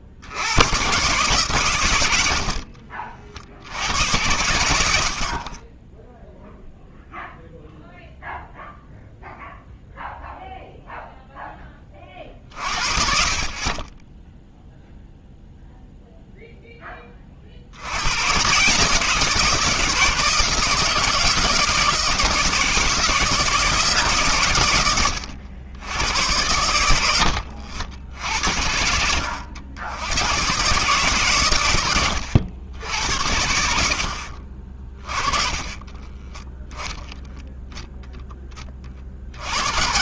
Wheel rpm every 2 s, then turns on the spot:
90, 70, 80, 0, 0, 0, 40, 0, 10, 140, 160, 160, 120, 90, 70, 130, 90, 40, 10, 30.
2-4 34-36